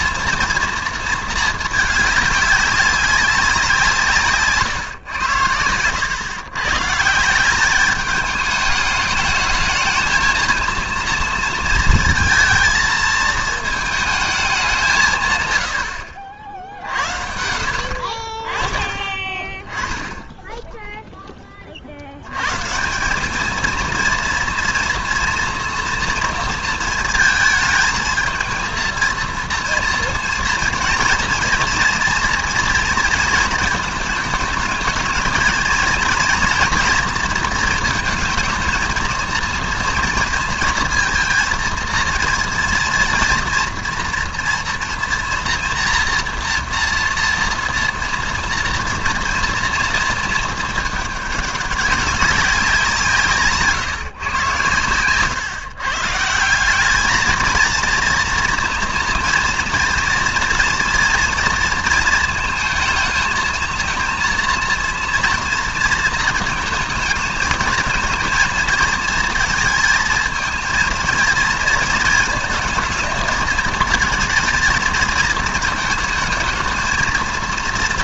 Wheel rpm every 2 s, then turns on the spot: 230, 200, 130, 140, 210, 230, 220, 180, 60, 30, 0, 170, 230, 230, 220, 230, 230, 210, 230, 230, 230, 230, 240, 230, 230, 220, 170, 110, 190, 230, 230, 220, 230, 220, 230, 220, 220, 220, 220.
none